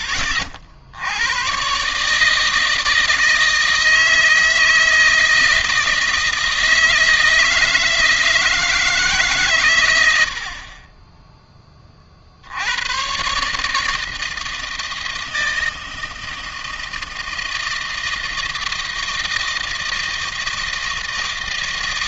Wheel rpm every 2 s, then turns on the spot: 80, 160, 160, 160, 150, 20, 110, 160, 160, 160, 160.
none